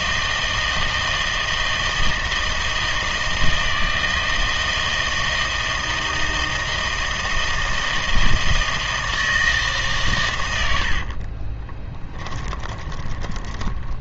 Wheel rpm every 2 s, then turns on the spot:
160, 160, 160, 160, 160, 80, 20.
12-14